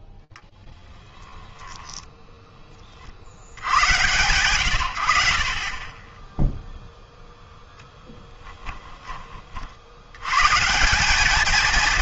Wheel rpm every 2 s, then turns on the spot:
10, 20, 110, 0, 10, 150.
8-10